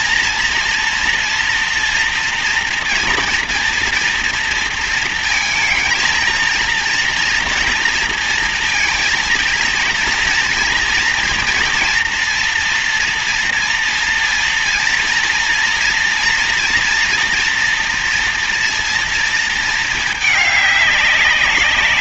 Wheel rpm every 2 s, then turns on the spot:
230, 240, 230, 230, 230, 230, 230, 230, 240, 230, 200.
none